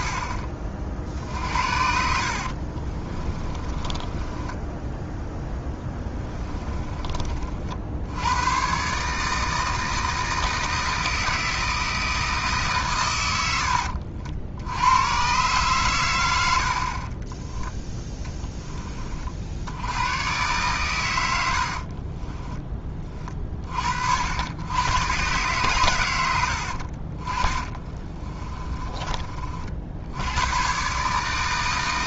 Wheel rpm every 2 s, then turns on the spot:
40, 40, 10, 20, 130, 160, 130, 90, 50, 20, 130, 30, 110, 70, 20, 130.
2-6 28-30